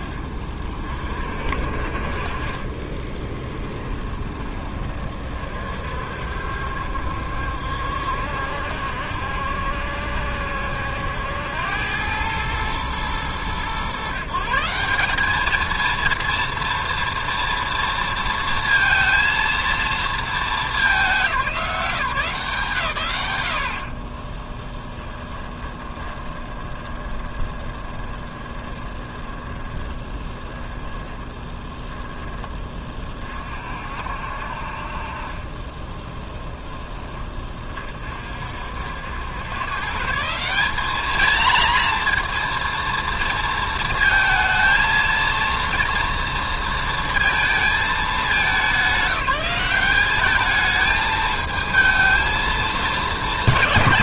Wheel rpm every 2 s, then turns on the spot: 30, 20, 20, 70, 70, 80, 110, 170, 230, 230, 200, 150, 10, 20, 20, 10, 30, 40, 20, 70, 200, 230, 230, 230, 180, 210, 220.
2-4 24-32